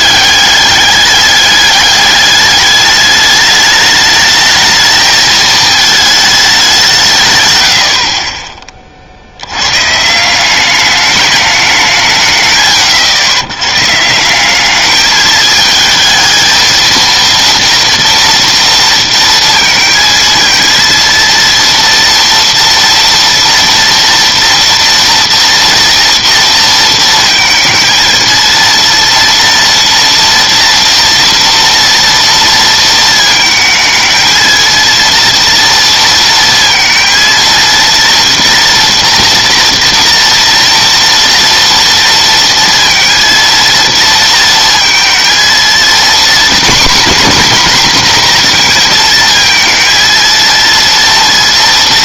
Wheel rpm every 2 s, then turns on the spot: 200, 210, 220, 210, 30, 180, 140, 190, 220, 230, 230, 240, 230, 230, 230, 230, 230, 220, 230, 230, 230, 230, 230, 240, 240, 230.
none